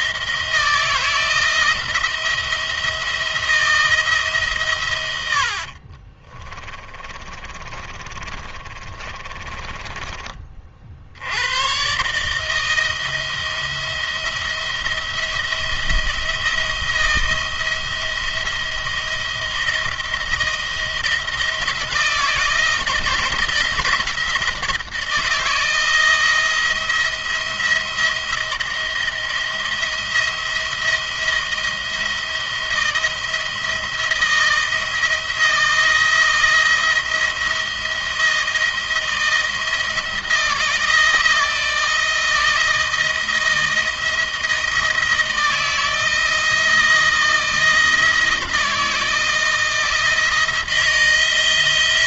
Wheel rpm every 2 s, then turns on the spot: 160, 170, 140, 40, 30, 40, 160, 170, 170, 170, 170, 160, 160, 170, 170, 170, 160, 170, 170, 170, 160, 160, 170, 170, 160, 160.
6-10